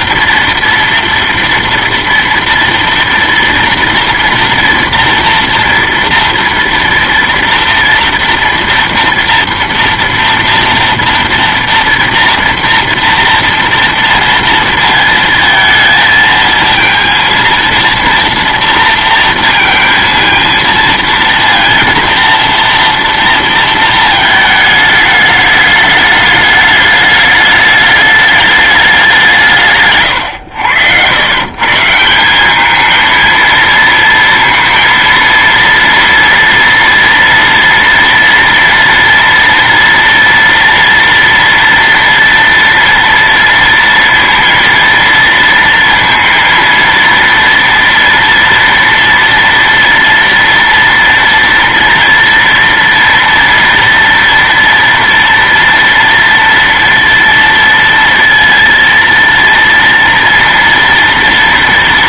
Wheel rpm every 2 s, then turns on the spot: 230, 230, 230, 230, 230, 230, 230, 230, 230, 230, 230, 230, 220, 210, 210, 110, 190, 230, 230, 230, 230, 230, 230, 230, 230, 230, 230, 230, 230, 230, 230.
none